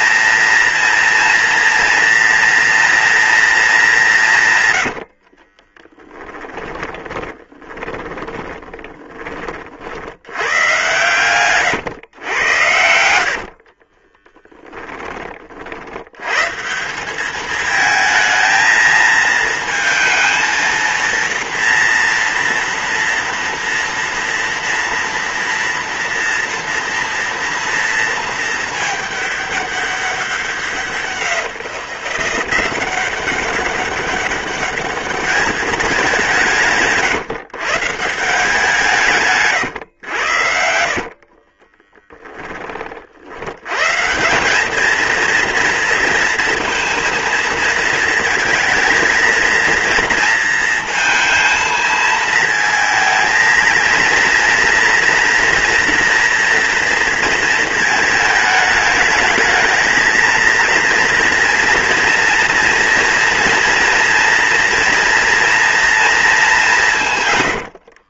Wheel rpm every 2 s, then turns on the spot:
230, 230, 90, 20, 20, 120, 80, 20, 180, 220, 230, 230, 230, 230, 210, 180, 180, 210, 150, 160, 60, 40, 220, 230, 230, 230, 220, 230, 230, 210, 230, 230, 230, 160.
4-8 12-14 40-42